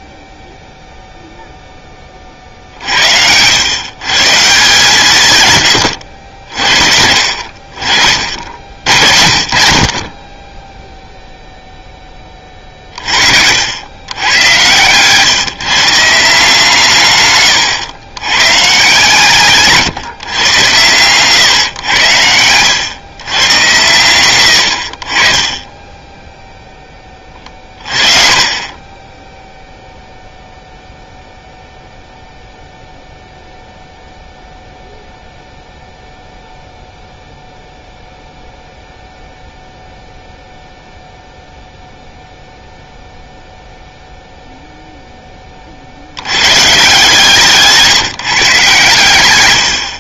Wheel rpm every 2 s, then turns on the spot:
0, 50, 160, 60, 70, 10, 30, 120, 150, 140, 130, 100, 70, 10, 20, 0, 0, 0, 0, 0, 0, 0, 0, 130, 140.
14-16